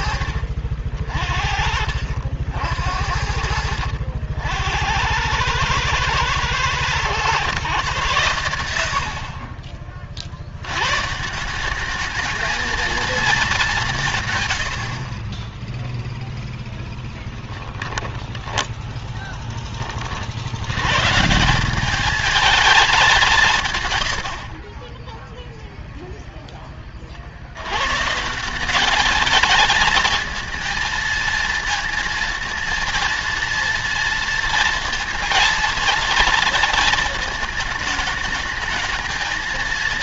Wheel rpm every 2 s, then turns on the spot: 50, 70, 90, 120, 80, 130, 220, 40, 10, 10, 120, 210, 10, 40, 210, 230, 230, 230, 230, 220.
16-20 24-26